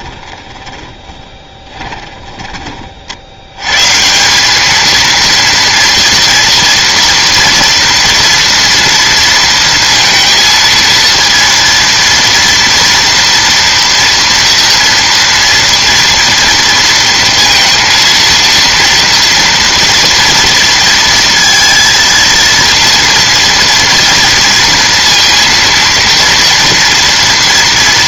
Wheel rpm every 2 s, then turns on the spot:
30, 30, 210, 240, 230, 230, 230, 230, 230, 230, 230, 230, 230, 240.
0-2